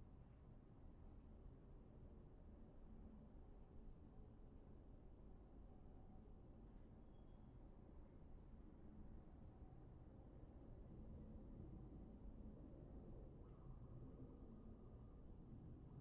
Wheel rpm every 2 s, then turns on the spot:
0, 0, 0, 0, 0, 0, 0, 0.
none